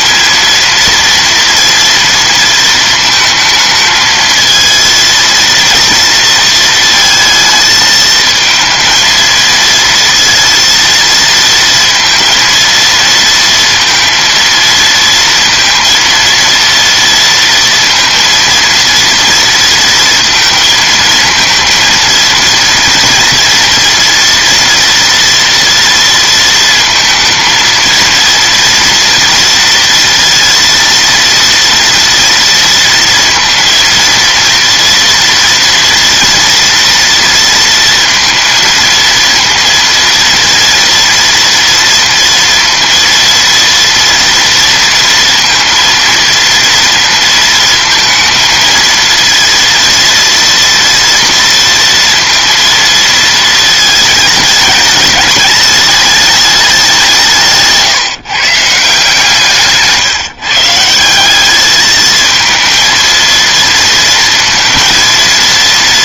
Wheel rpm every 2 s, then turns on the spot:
230, 220, 230, 220, 220, 230, 230, 230, 230, 230, 220, 230, 230, 220, 230, 230, 230, 230, 230, 230, 230, 230, 230, 230, 230, 230, 230, 210, 170, 150, 180, 230, 230.
none